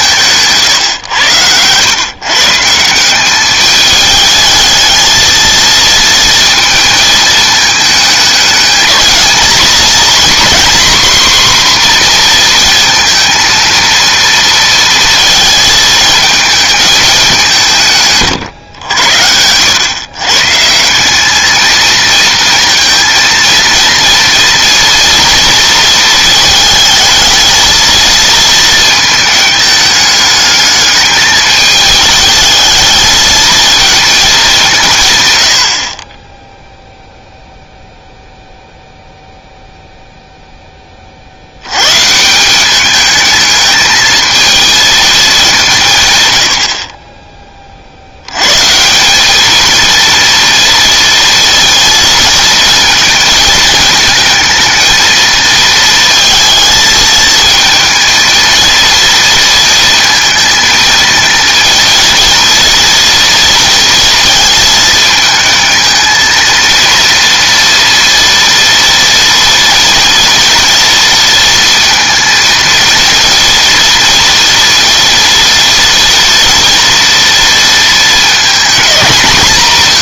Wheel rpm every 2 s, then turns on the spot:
140, 170, 220, 230, 220, 260, 230, 230, 220, 100, 170, 230, 230, 220, 220, 210, 220, 170, 0, 0, 10, 200, 230, 60, 150, 230, 230, 230, 220, 230, 220, 230, 220, 230, 230, 230, 230, 230, 230, 220.
none